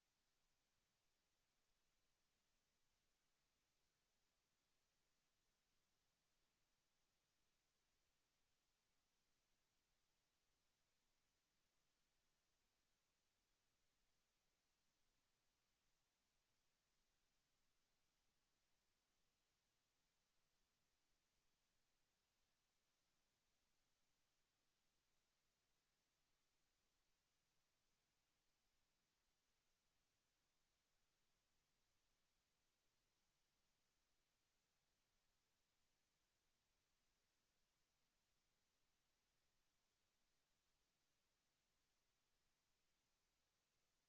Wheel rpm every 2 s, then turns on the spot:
0, 0, 0, 0, 0, 0, 0, 0, 0, 0, 0, 0, 0, 0, 0, 0, 0, 0, 0, 0, 0, 0.
none